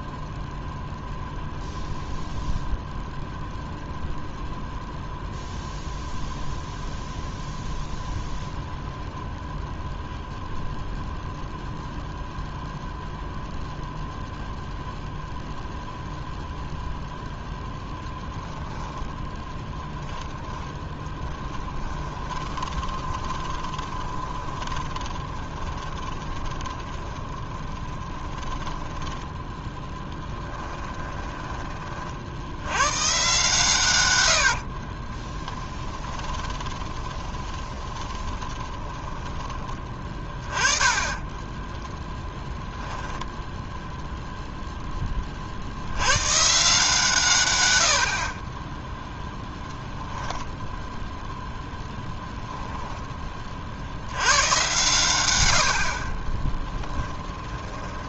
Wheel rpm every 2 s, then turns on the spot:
0, 0, 0, 0, 0, 0, 0, 0, 0, 10, 10, 20, 20, 20, 10, 10, 90, 60, 20, 20, 20, 0, 0, 150, 10, 0, 0, 110, 20.
18-32 34-42 56-58